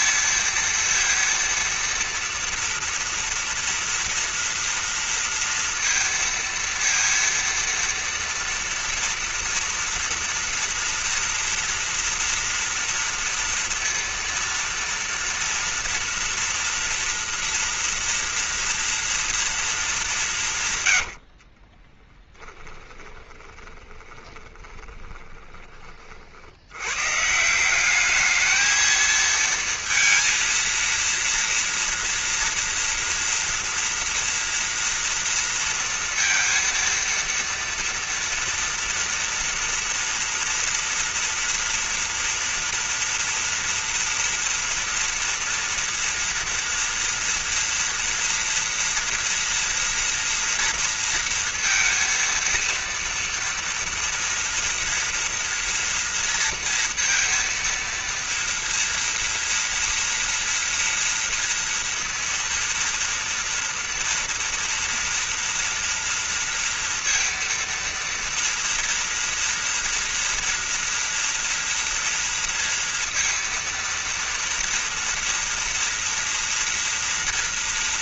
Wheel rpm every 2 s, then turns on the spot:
230, 230, 230, 230, 230, 230, 240, 230, 230, 230, 170, 20, 20, 80, 220, 230, 230, 230, 230, 230, 230, 230, 230, 230, 240, 230, 230, 230, 230, 230, 240, 230, 230, 230, 230, 230, 230, 230, 230.
22-26